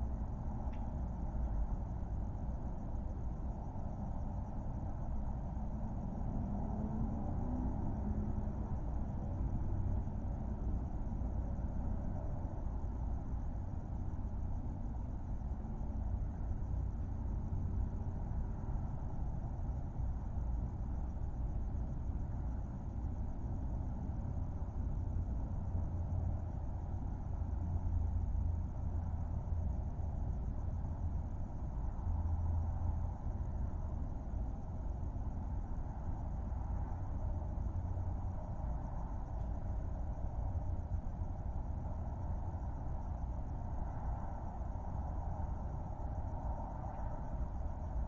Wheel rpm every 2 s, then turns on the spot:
0, 0, 0, 0, 0, 0, 0, 0, 0, 0, 0, 0, 0, 0, 0, 0, 0, 0, 0, 0, 0, 0, 0, 0.
none